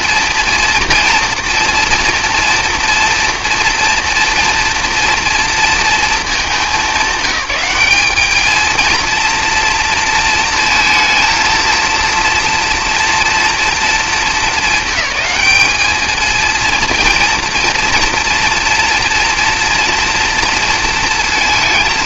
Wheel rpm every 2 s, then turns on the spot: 230, 230, 230, 200, 220, 230, 230, 220, 230, 230, 230.
none